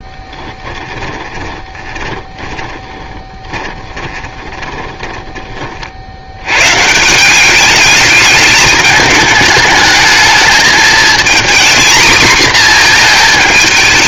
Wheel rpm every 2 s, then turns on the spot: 10, 20, 10, 110, 210, 220, 230.
0-6